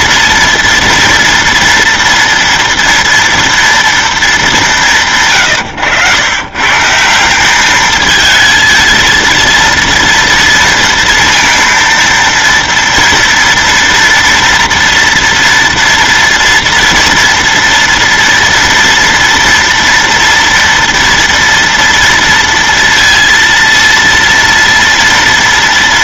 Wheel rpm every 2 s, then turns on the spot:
230, 230, 190, 140, 220, 230, 230, 230, 230, 230, 230, 230, 230.
none